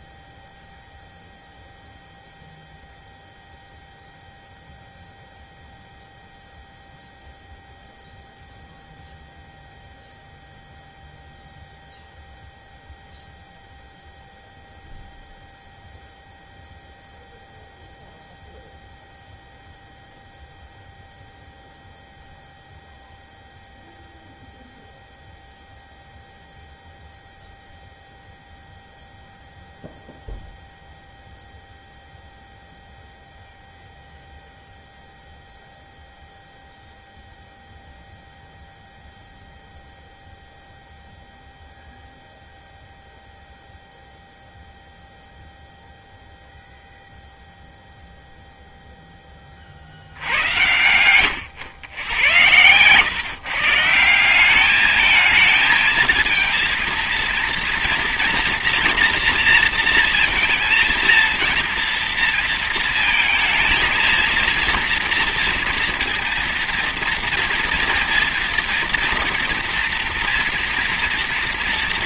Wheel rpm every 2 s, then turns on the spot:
0, 0, 0, 0, 0, 0, 0, 0, 0, 0, 0, 0, 0, 0, 0, 0, 0, 0, 0, 0, 0, 0, 0, 0, 10, 100, 120, 210, 230, 240, 230, 230, 230, 230, 230, 230.
none